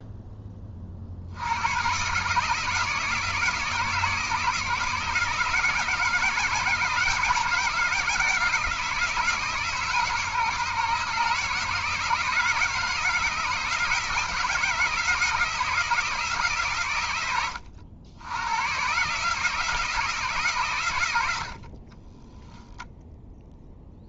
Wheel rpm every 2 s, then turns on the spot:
20, 150, 150, 160, 160, 150, 170, 170, 140, 100, 140, 10.
22-24